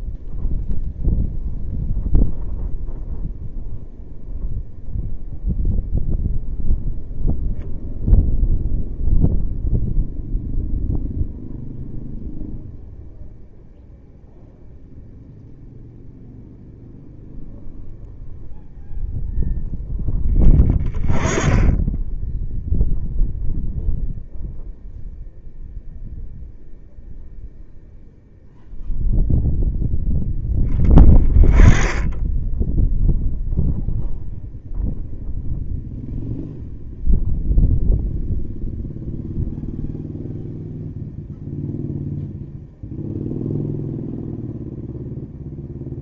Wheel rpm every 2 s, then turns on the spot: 0, 0, 0, 0, 0, 0, 0, 0, 0, 0, 10, 0, 0, 0, 0, 10, 10, 0, 0, 0, 0, 0, 0.
none